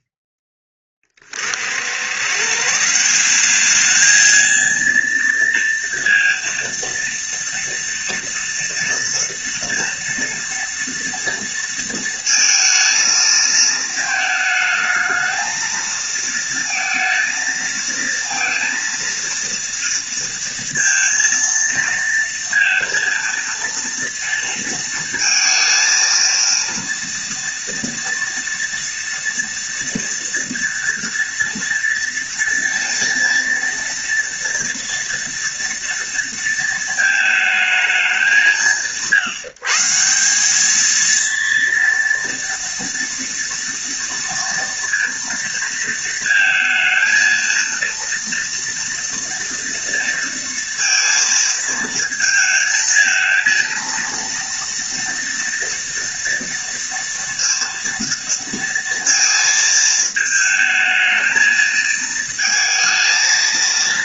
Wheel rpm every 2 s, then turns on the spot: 10, 150, 230, 230, 230, 230, 220, 220, 230, 230, 230, 230, 230, 230, 230, 230, 230, 230, 220, 150, 210, 230, 230, 230, 230, 230, 230, 230, 230, 230, 220, 220.
none